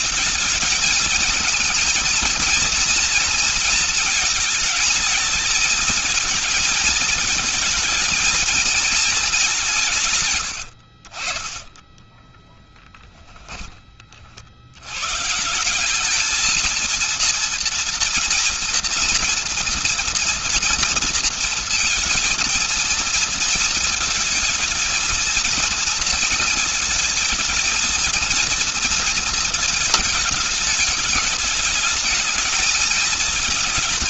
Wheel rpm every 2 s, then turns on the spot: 230, 230, 220, 220, 220, 60, 20, 110, 230, 240, 230, 220, 230, 230, 230, 210, 220.
12-14